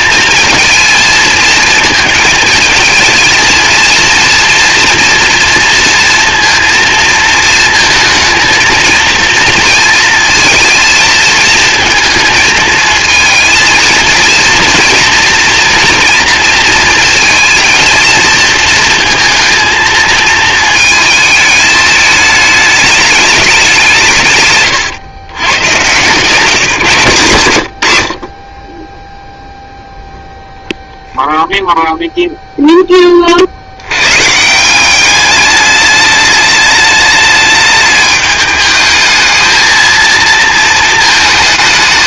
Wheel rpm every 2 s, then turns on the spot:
220, 220, 230, 230, 230, 230, 220, 230, 230, 230, 220, 210, 120, 160, 20, 0, 10, 180, 210, 220, 220.
26-28